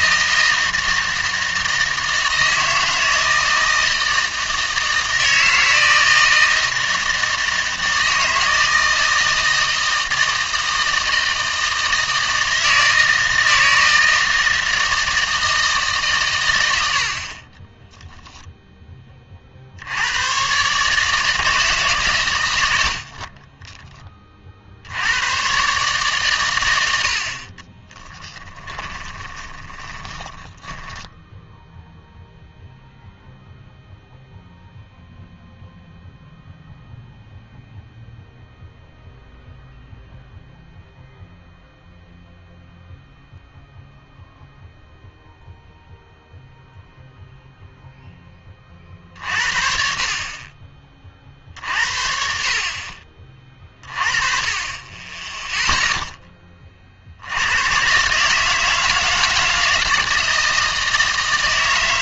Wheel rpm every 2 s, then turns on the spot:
160, 160, 160, 160, 160, 160, 160, 160, 90, 0, 140, 90, 60, 90, 10, 20, 0, 0, 0, 0, 0, 0, 0, 0, 30, 40, 50, 30, 40, 160, 160.
28-32